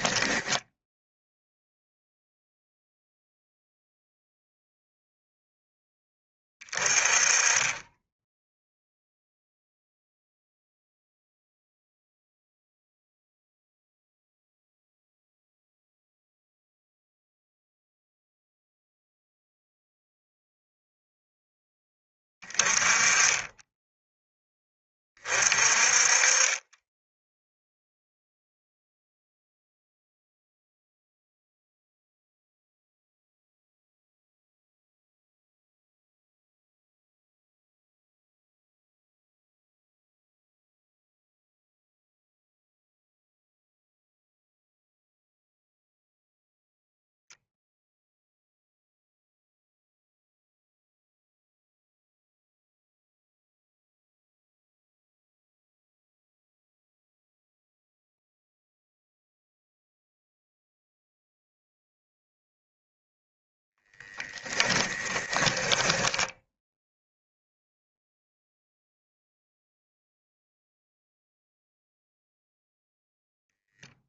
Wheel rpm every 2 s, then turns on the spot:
0, 0, 0, 20, 0, 0, 0, 0, 0, 0, 0, 20, 30, 10, 0, 0, 0, 0, 0, 0, 0, 0, 0, 0, 0, 0, 0, 0, 0, 0, 0, 0, 10, 0, 0, 0, 0.
64-66